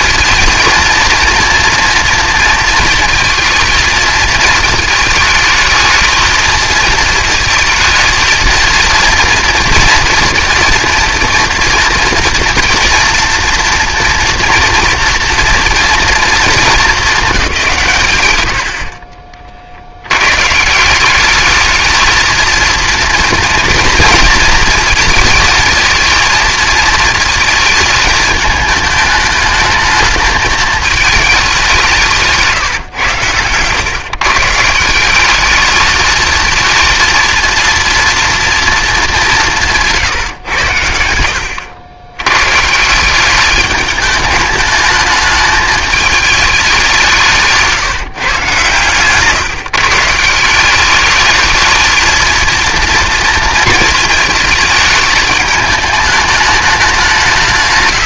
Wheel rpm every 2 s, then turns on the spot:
230, 230, 220, 230, 230, 230, 230, 230, 210, 60, 170, 230, 230, 230, 210, 210, 130, 160, 230, 220, 90, 160, 210, 190, 130, 200, 230, 210, 190.
none